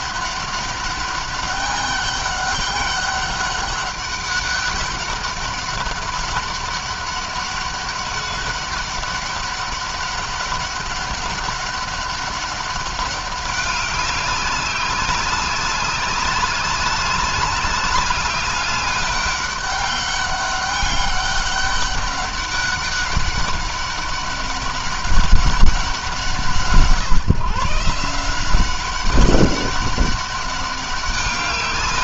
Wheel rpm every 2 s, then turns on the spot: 200, 200, 200, 200, 200, 200, 200, 190, 200, 200, 200, 200, 200, 150, 190, 200.
none